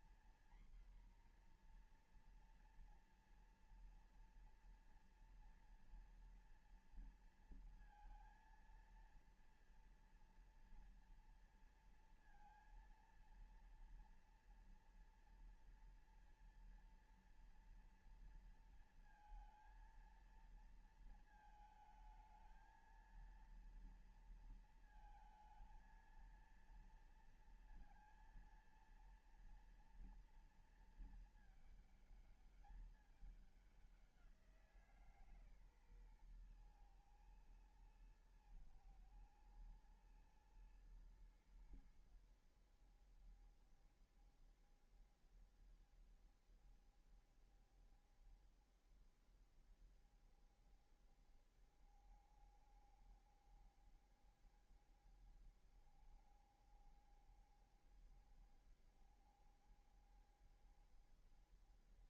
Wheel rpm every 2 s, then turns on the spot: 240, 240, 230, 230, 230, 240, 230, 230, 230, 230, 230, 220, 230, 230, 230, 230, 210, 180, 130, 120, 110, 90, 70, 70, 70, 70, 70, 70, 70, 70, 70.
none